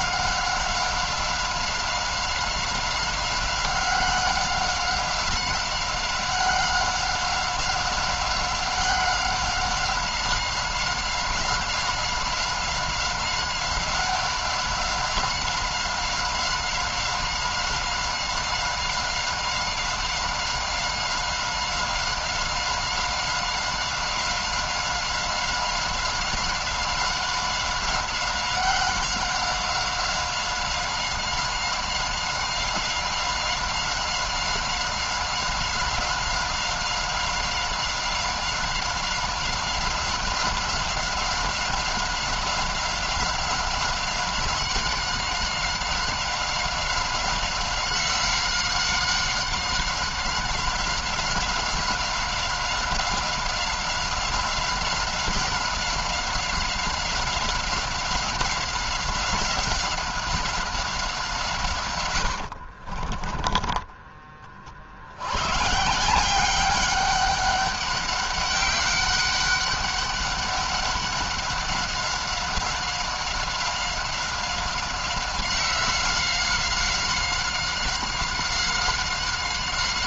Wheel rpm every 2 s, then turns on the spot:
190, 190, 190, 190, 190, 190, 190, 190, 190, 190, 190, 190, 190, 190, 190, 190, 190, 190, 190, 190, 190, 190, 190, 190, 190, 190, 190, 190, 190, 180, 190, 80, 40, 180, 200, 200, 190, 190, 190, 190.
62-64